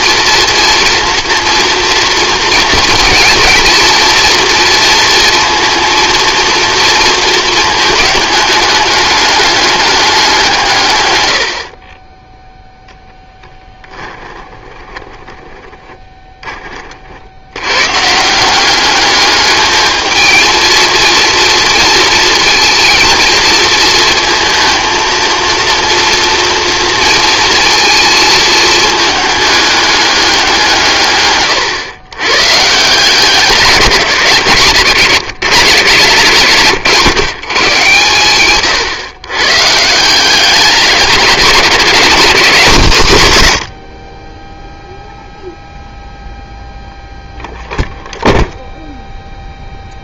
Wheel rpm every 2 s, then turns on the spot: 230, 240, 230, 230, 210, 140, 0, 10, 30, 200, 230, 230, 230, 230, 220, 150, 150, 150, 110, 120, 210, 190, 0, 0, 0.
none